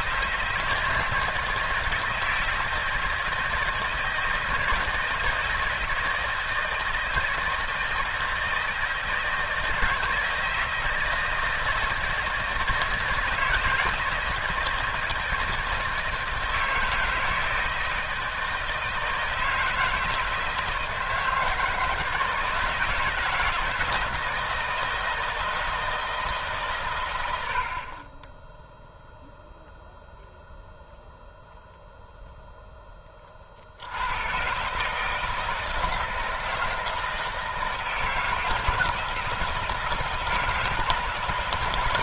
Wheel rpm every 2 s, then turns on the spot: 160, 160, 160, 160, 160, 160, 160, 160, 160, 160, 160, 160, 160, 130, 0, 0, 0, 140, 160, 160, 160.
none